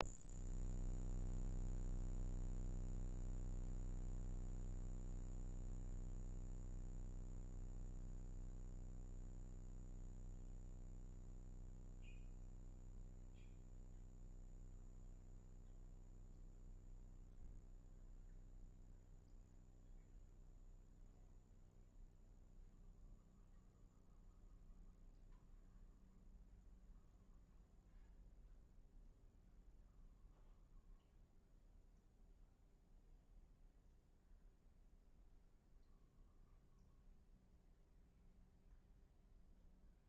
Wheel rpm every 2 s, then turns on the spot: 0, 0, 0, 0, 0, 0, 0, 0, 0, 0, 0, 0, 0, 0, 0, 0, 0, 0, 0, 0.
none